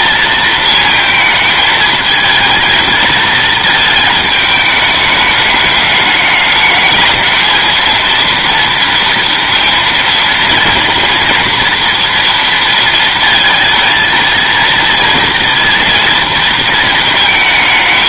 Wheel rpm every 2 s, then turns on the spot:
220, 230, 210, 220, 230, 230, 230, 230, 220.
none